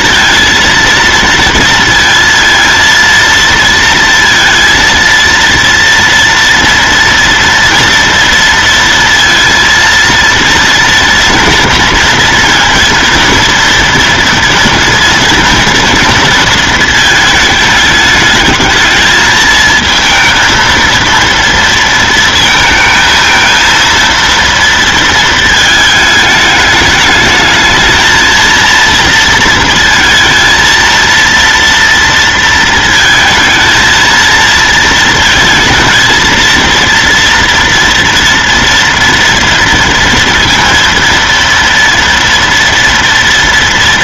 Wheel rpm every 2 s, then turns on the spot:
230, 230, 230, 240, 230, 230, 240, 230, 230, 220, 230, 230, 230, 210, 230, 230, 230, 230, 230, 230, 230, 230.
none